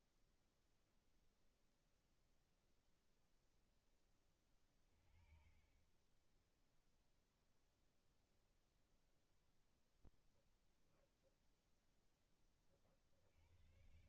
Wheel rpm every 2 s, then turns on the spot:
0, 0, 20, 0, 0, 0, 30.
none